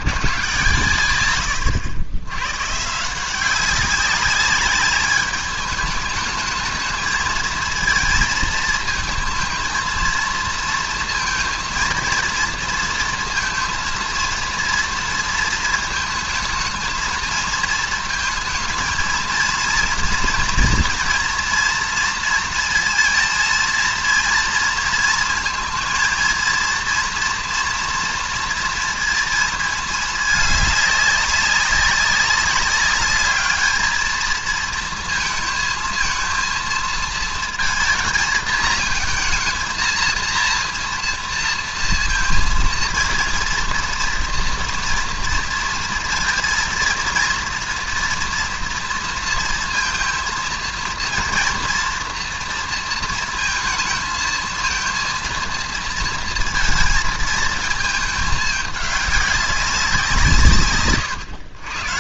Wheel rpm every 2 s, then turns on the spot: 130, 140, 200, 220, 220, 230, 230, 230, 220, 220, 240, 230, 230, 230, 230, 210, 200, 230, 230, 220, 230, 230, 230, 230, 230, 230, 230, 230, 230, 210, 130.
none